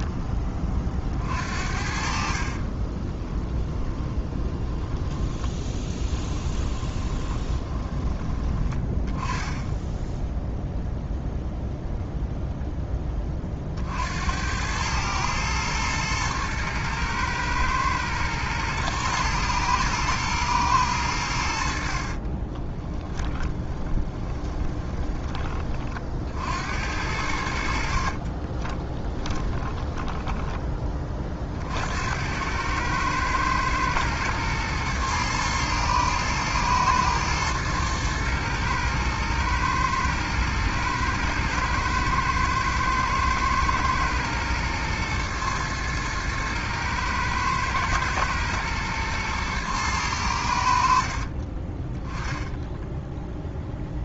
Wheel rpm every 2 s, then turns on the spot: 40, 30, 10, 20, 20, 0, 10, 110, 110, 110, 100, 10, 20, 70, 20, 20, 110, 110, 110, 110, 110, 110, 110, 110, 110, 60, 20.
2-4 6-8 22-26 28-30 52-54